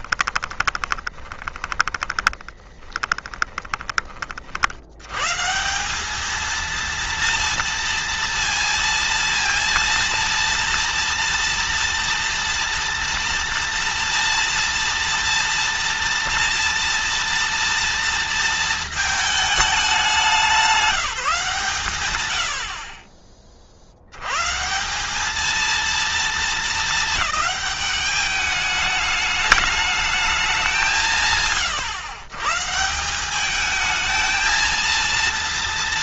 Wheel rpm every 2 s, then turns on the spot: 20, 20, 100, 230, 230, 230, 230, 230, 230, 220, 180, 50, 200, 210, 210, 180, 160, 230.
0-4